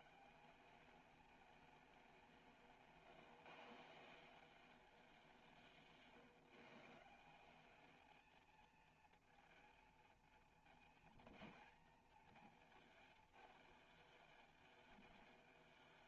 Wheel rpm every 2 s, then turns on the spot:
200, 170, 200, 140, 230, 230, 230, 220.
none